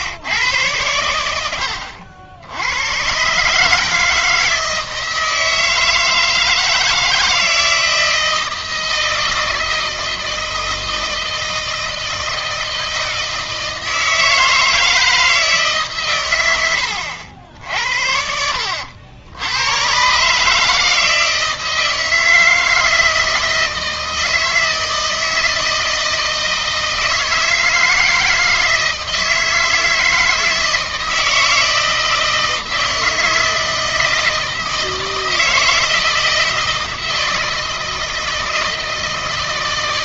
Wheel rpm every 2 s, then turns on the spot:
110, 100, 160, 160, 160, 160, 160, 160, 100, 80, 150, 160, 160, 160, 160, 160, 160, 160, 160, 160.
16-18